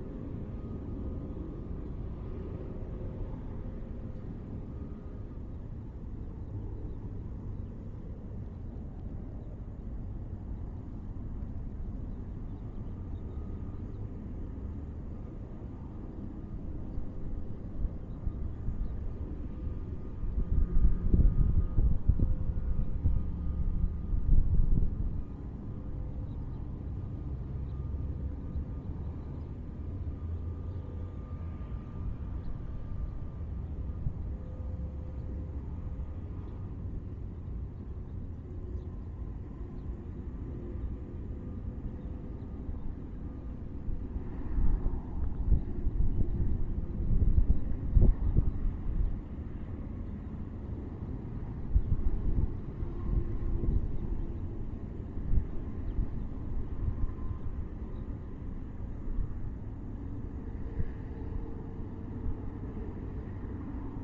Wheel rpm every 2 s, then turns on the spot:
0, 0, 0, 0, 0, 0, 0, 0, 0, 0, 0, 0, 0, 0, 0, 0, 0, 0, 0, 0, 0, 0, 0, 0, 0, 0, 0, 0, 0, 0, 0, 0.
none